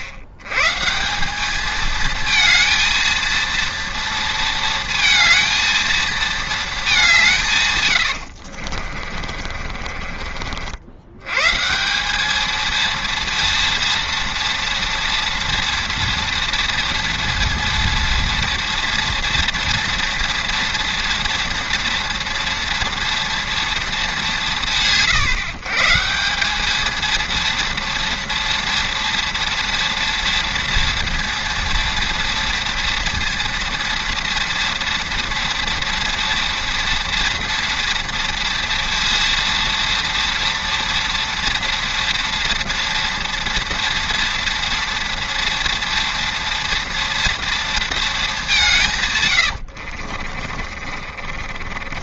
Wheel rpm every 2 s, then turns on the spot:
110, 220, 230, 220, 50, 60, 220, 230, 230, 230, 230, 230, 150, 200, 230, 230, 230, 230, 230, 230, 230, 230, 230, 230, 170, 40.
8-10 50-52